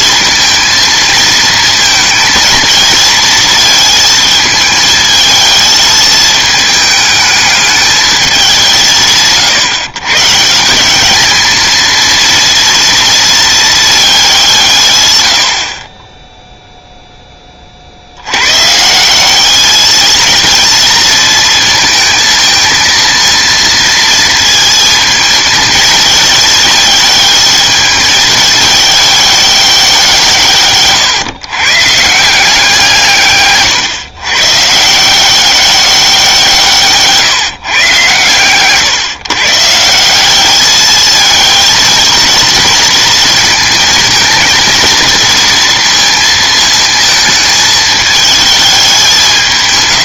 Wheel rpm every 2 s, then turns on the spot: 220, 220, 220, 220, 180, 180, 230, 150, 0, 140, 230, 220, 230, 220, 210, 130, 170, 150, 160, 120, 210, 220, 230, 220, 210.
none